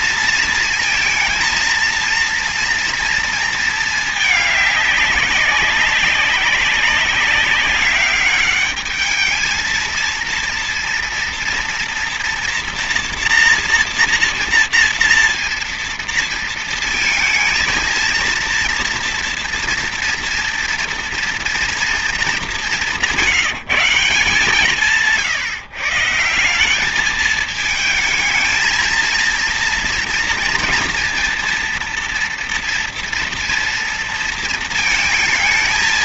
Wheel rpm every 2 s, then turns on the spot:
230, 230, 210, 190, 200, 230, 230, 230, 230, 230, 230, 200, 170, 170, 220, 230, 230, 230.
none